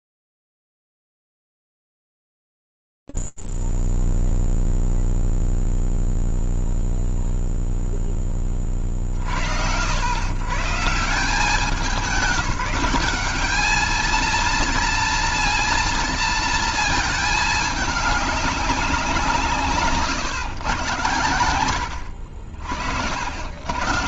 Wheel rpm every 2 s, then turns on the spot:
0, 0, 0, 0, 10, 100, 180, 230, 230, 210, 130, 70.
none